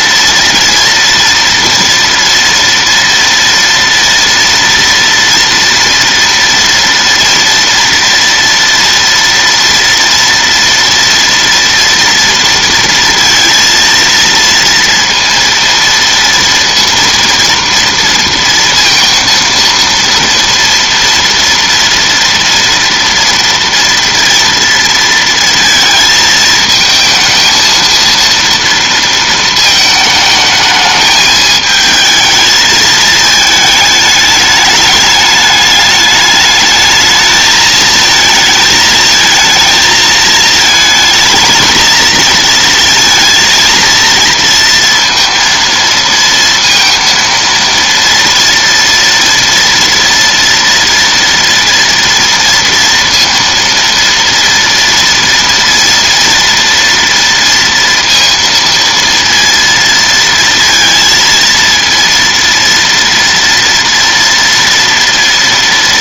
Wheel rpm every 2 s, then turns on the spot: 230, 230, 230, 230, 230, 230, 230, 230, 230, 230, 240, 230, 230, 220, 230, 220, 220, 210, 210, 220, 220, 230, 230, 230, 230, 230, 230, 230, 230, 230, 230, 230, 230.
none